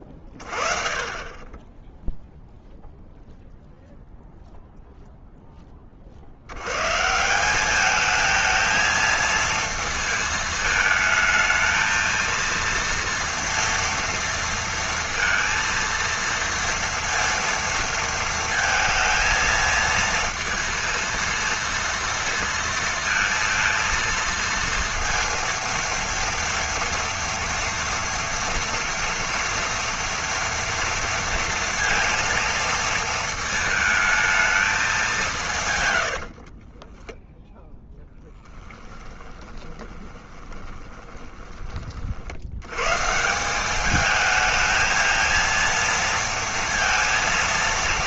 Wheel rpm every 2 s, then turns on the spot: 20, 0, 0, 160, 230, 220, 230, 230, 230, 220, 230, 230, 230, 230, 230, 230, 220, 130, 10, 20, 20, 190, 230, 230.
34-36 38-40